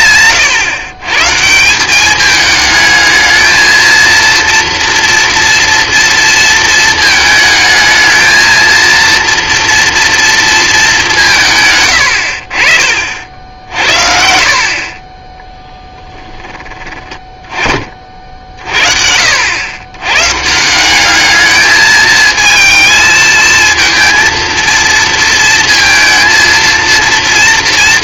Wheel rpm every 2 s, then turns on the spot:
130, 210, 230, 220, 230, 220, 40, 50, 20, 50, 160, 220, 230, 230.
none